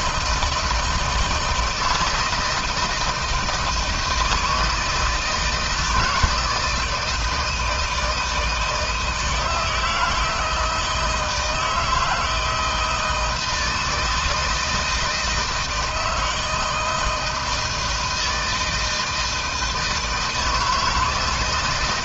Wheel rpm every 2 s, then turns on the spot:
170, 160, 160, 160, 160, 160, 160, 160, 160, 160, 160.
none